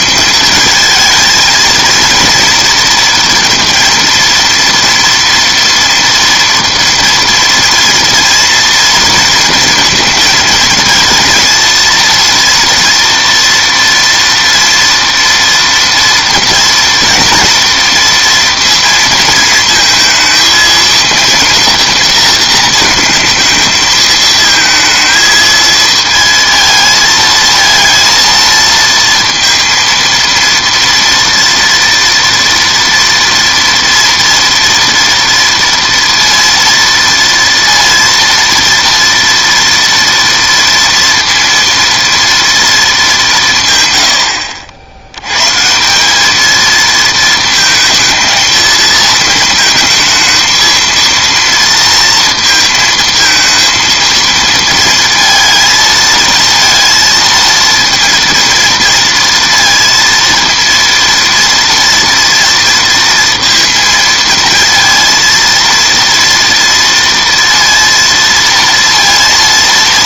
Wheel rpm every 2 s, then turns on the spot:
220, 230, 230, 230, 230, 220, 230, 230, 230, 230, 230, 220, 220, 220, 230, 230, 230, 230, 230, 230, 230, 220, 70, 220, 220, 230, 230, 230, 230, 230, 230, 230, 230, 230, 230.
none